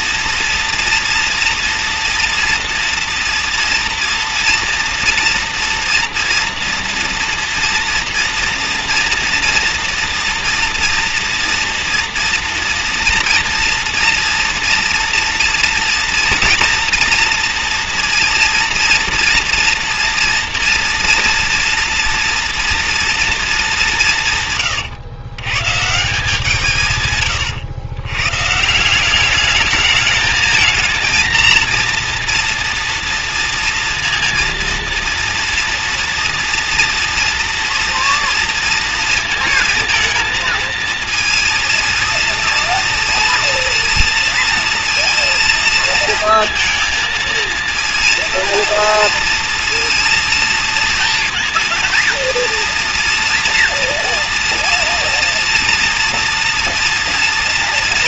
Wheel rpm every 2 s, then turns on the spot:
230, 230, 230, 230, 240, 240, 230, 230, 240, 230, 230, 230, 120, 130, 170, 220, 230, 230, 230, 230, 230, 230, 230, 230, 230, 230, 240, 230, 230.
none